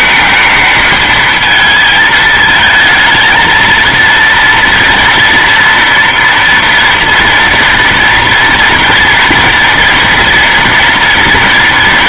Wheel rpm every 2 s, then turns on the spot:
220, 220, 230, 230, 230, 230.
none